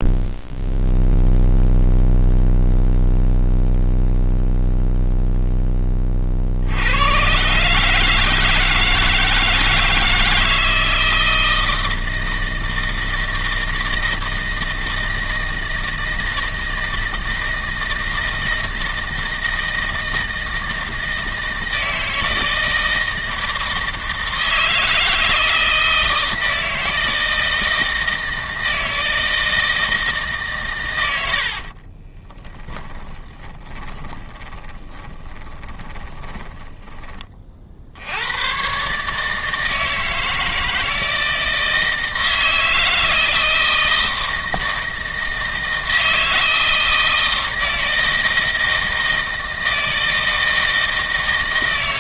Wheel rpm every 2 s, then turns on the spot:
0, 0, 0, 50, 160, 160, 160, 160, 160, 160, 160, 160, 160, 160, 160, 150, 20, 20, 20, 110, 160, 160, 160, 160, 160, 160.
32-38